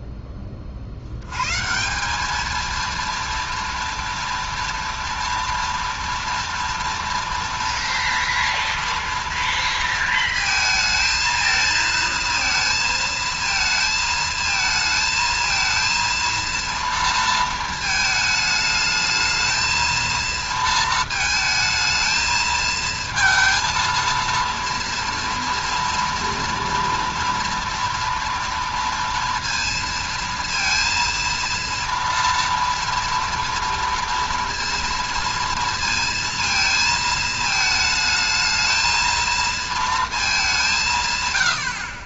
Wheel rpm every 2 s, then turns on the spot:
40, 230, 230, 230, 230, 220, 230, 230, 230, 220, 230, 220, 230, 230, 230, 230, 230, 230, 220, 220, 180.
none